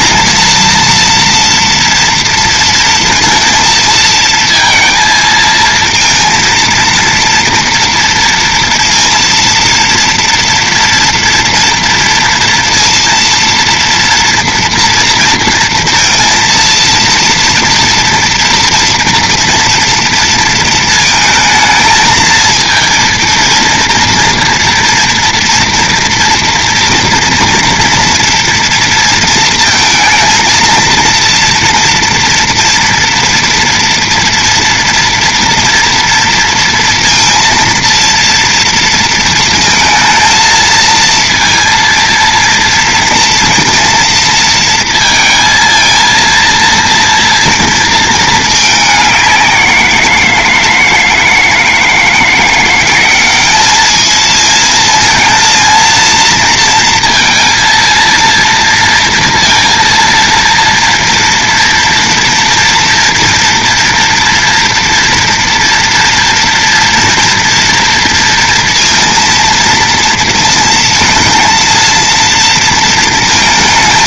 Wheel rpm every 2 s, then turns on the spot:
230, 230, 230, 230, 230, 230, 230, 230, 230, 230, 230, 220, 230, 230, 230, 230, 230, 230, 230, 230, 230, 230, 230, 230, 210, 160, 170, 220, 230, 230, 230, 230, 230, 230, 230, 230, 230.
none